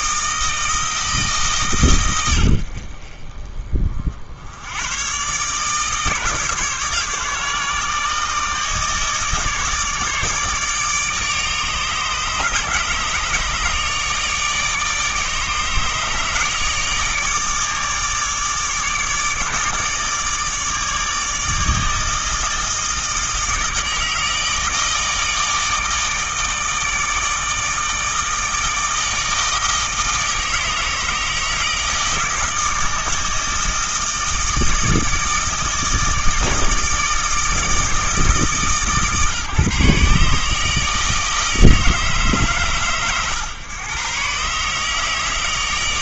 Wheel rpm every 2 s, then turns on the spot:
160, 50, 110, 150, 150, 150, 150, 150, 150, 150, 150, 160, 160, 160, 160, 160, 160, 160, 160, 140, 160, 120, 150.
none